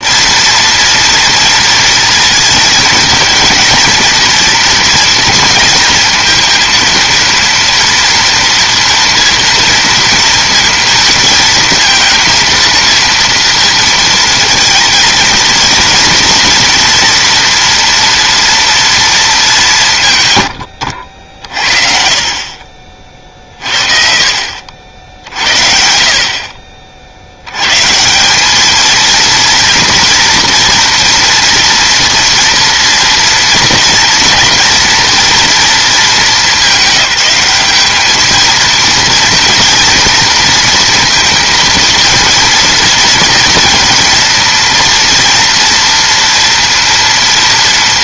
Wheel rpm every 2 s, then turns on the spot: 230, 220, 230, 230, 230, 230, 230, 230, 230, 230, 80, 40, 60, 50, 220, 230, 230, 240, 200, 220, 230, 230, 230, 230.
none